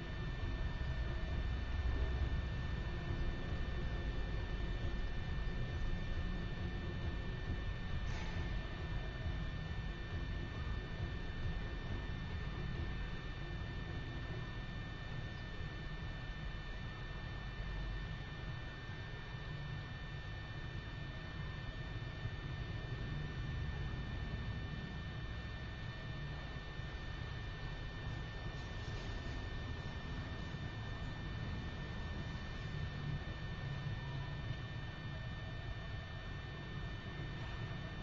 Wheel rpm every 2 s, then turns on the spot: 0, 0, 0, 0, 0, 0, 0, 0, 0, 0, 0, 0, 0, 0, 0, 0, 0, 0, 0.
none